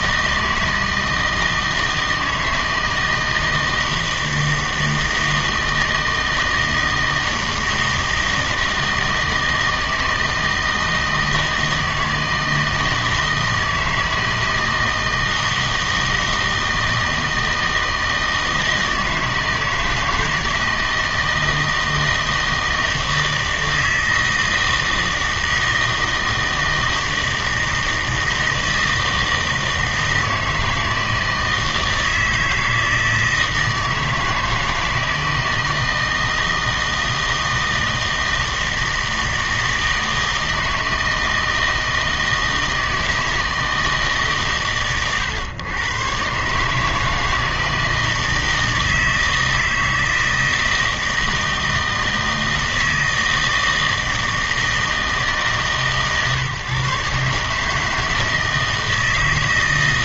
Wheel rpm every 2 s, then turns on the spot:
160, 160, 160, 160, 160, 160, 160, 160, 160, 160, 160, 160, 160, 160, 160, 160, 160, 160, 160, 160, 160, 160, 130, 140, 160, 160, 160, 160, 140, 160.
none